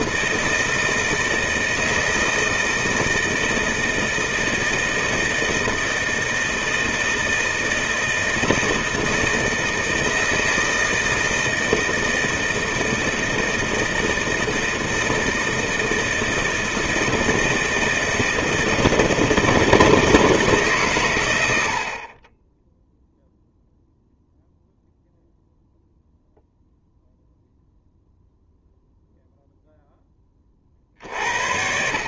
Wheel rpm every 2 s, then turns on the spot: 160, 160, 160, 160, 160, 160, 160, 160, 160, 160, 140, 10, 0, 0, 0, 40.
none